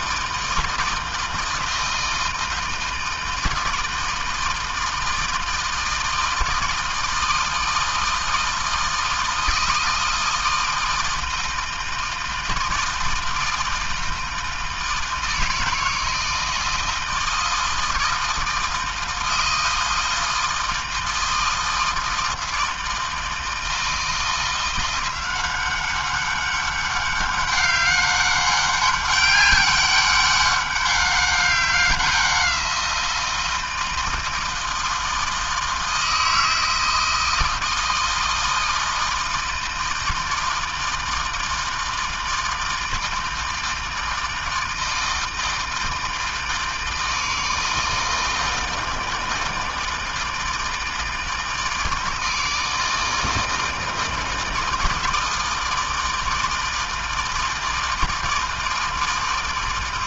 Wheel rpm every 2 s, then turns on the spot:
160, 160, 160, 160, 160, 160, 160, 160, 160, 160, 160, 160, 180, 200, 200, 200, 170, 160, 160, 160, 160, 160, 160, 160, 160, 150, 160, 160, 160, 160.
none